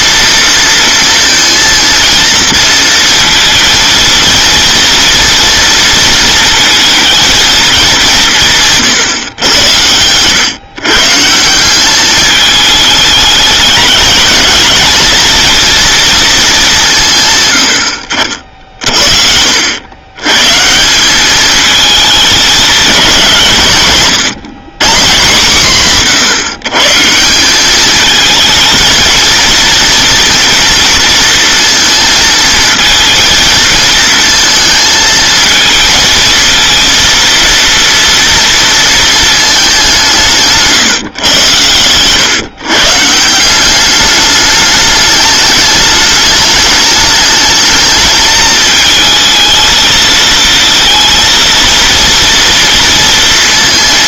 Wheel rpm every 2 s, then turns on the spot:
230, 230, 230, 230, 140, 140, 210, 230, 170, 50, 180, 200, 150, 160, 220, 230, 220, 220, 230, 230, 150, 150, 210, 210, 220, 230, 230.
none